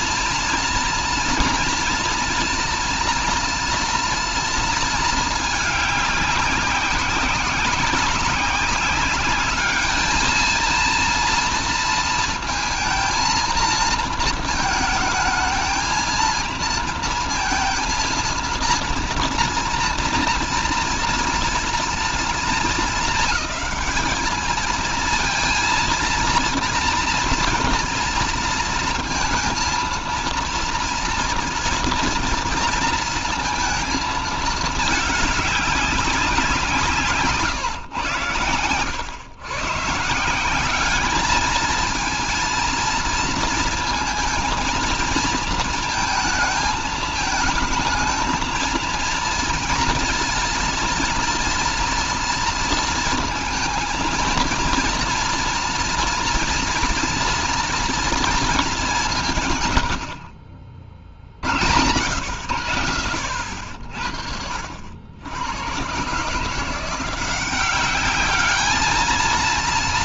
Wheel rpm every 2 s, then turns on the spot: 230, 230, 230, 190, 190, 230, 230, 220, 230, 230, 230, 220, 220, 240, 230, 230, 230, 210, 160, 110, 200, 230, 230, 220, 230, 230, 230, 230, 230, 190, 50, 90, 70, 170, 220.
none